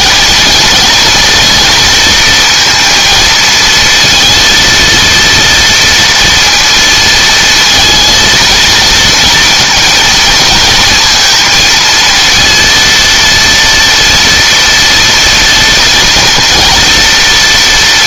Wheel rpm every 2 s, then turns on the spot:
230, 230, 230, 230, 230, 230, 230, 240, 230.
none